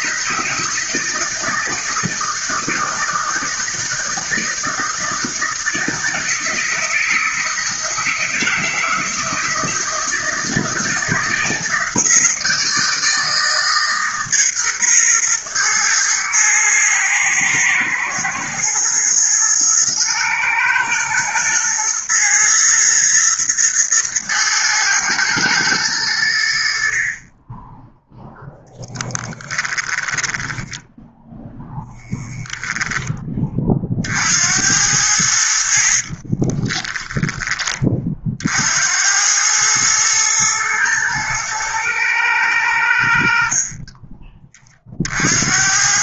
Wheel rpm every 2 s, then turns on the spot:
160, 160, 160, 160, 160, 160, 160, 130, 110, 120, 120, 110, 110, 50, 10, 10, 10, 80, 20, 80, 120, 80, 40.
30-32 36-38